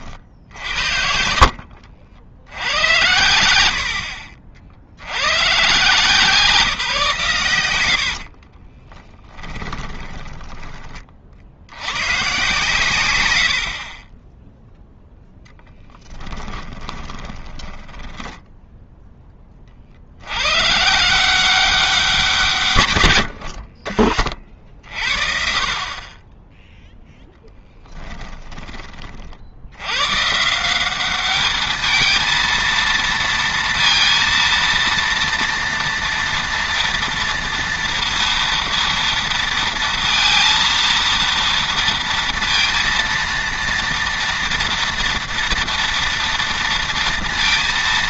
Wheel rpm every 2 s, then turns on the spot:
70, 90, 40, 160, 20, 10, 120, 0, 10, 0, 120, 140, 40, 0, 20, 180, 230, 230, 230, 230, 230, 230, 230, 230.
8-10 16-18